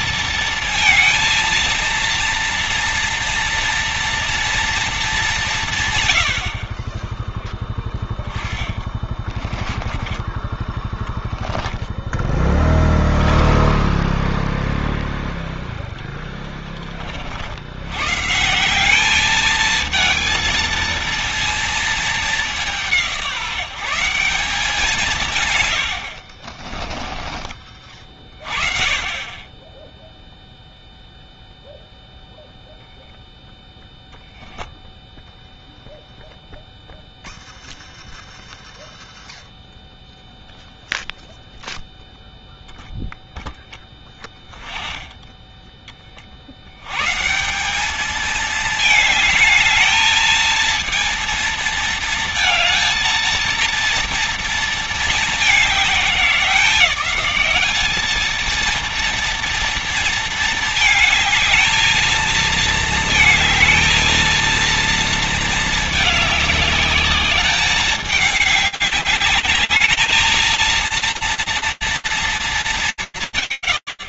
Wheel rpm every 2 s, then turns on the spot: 230, 230, 230, 50, 10, 20, 10, 10, 20, 140, 230, 200, 180, 50, 40, 0, 0, 0, 0, 0, 0, 0, 10, 50, 210, 220, 220, 230, 190, 220, 230, 230, 230, 210, 210, 230, 150.
8-10 26-28